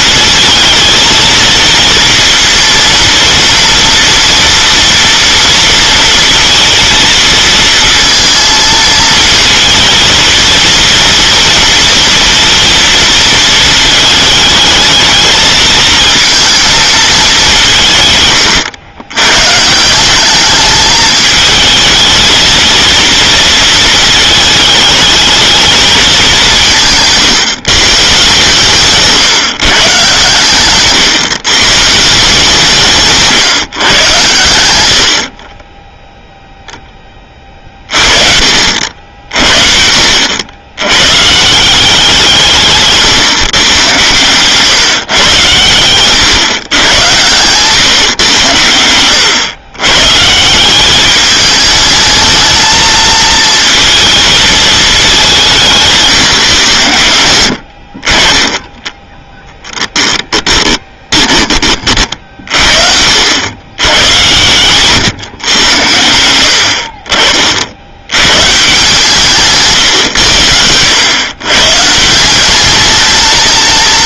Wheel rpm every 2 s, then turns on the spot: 230, 230, 230, 230, 230, 230, 230, 220, 220, 100, 210, 230, 220, 170, 150, 130, 160, 110, 10, 60, 100, 160, 140, 120, 100, 180, 220, 220, 110, 10, 10, 50, 120, 70, 150, 90, 210.
60-62 70-72